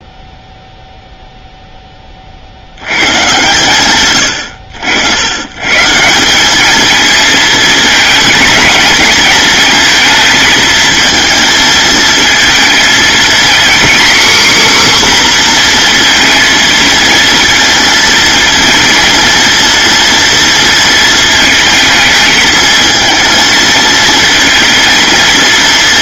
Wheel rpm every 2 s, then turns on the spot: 0, 110, 90, 220, 210, 230, 230, 270, 230, 230, 230, 220, 230.
none